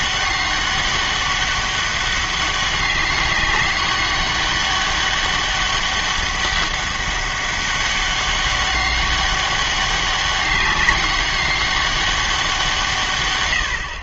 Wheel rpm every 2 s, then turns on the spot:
200, 200, 200, 200, 200, 200, 170.
none